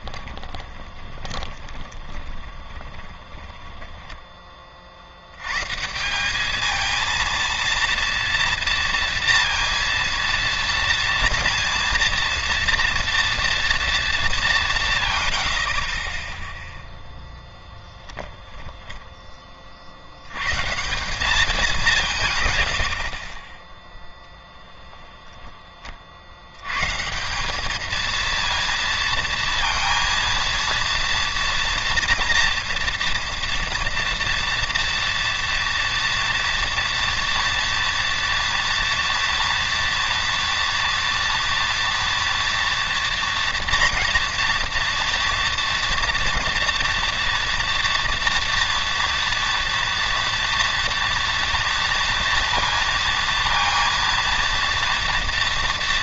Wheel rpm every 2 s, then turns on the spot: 20, 30, 30, 210, 230, 230, 230, 200, 0, 0, 130, 120, 10, 90, 230, 230, 230, 230, 240, 240, 230, 240, 240, 230, 230, 230, 230, 230.
0-4